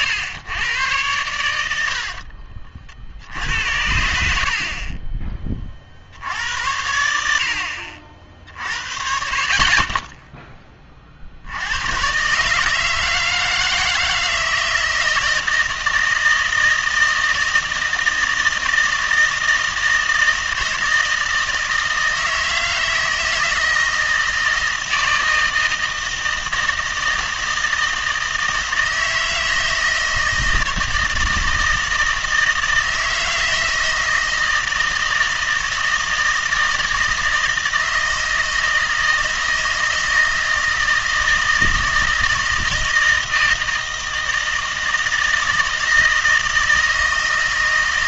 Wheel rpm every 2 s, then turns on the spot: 110, 50, 50, 80, 50, 20, 150, 160, 160, 160, 160, 160, 160, 160, 160, 160, 160, 160, 160, 160, 160, 160, 160, 160.
none